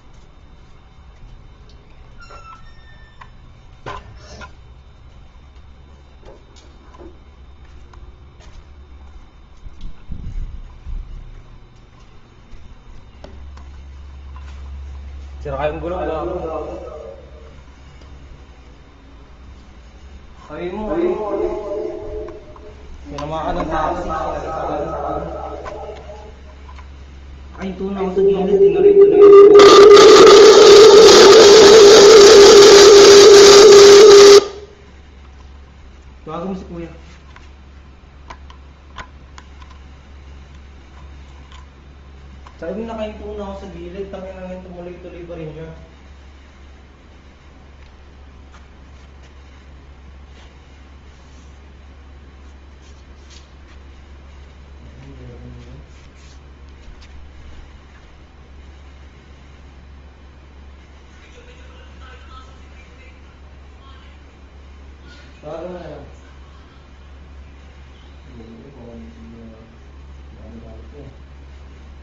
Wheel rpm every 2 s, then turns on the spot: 0, 0, 0, 0, 0, 0, 0, 0, 0, 0, 0, 0, 0, 0, 0, 0, 0, 0, 0, 0, 0, 0, 0, 0, 0, 0, 0, 0, 0, 0, 0, 0, 0, 0, 0, 0.
none